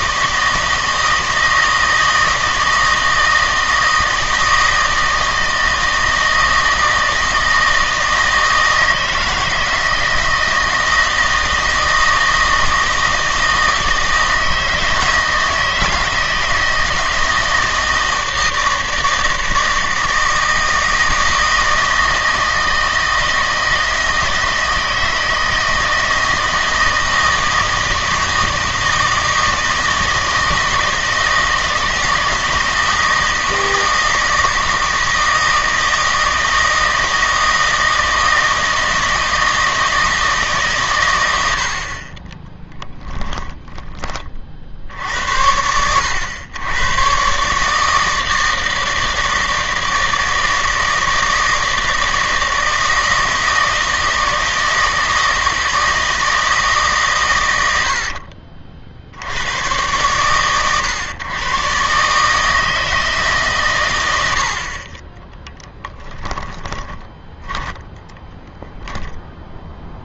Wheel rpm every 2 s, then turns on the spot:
160, 160, 160, 160, 160, 160, 160, 160, 160, 160, 160, 160, 160, 160, 160, 160, 160, 160, 160, 160, 130, 10, 70, 110, 160, 160, 160, 160, 150, 50, 110, 160, 50, 10, 0.
42-44 66-68